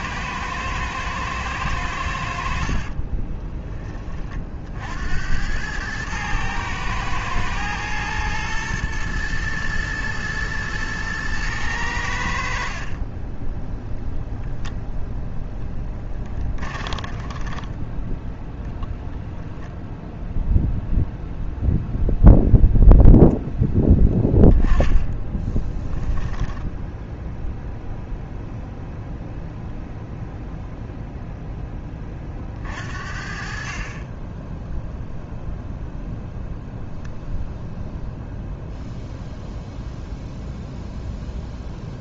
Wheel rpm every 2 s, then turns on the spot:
110, 70, 60, 110, 110, 110, 50, 0, 20, 10, 0, 0, 10, 10, 0, 0, 40, 0, 0, 0, 0.
2-4 16-18 26-28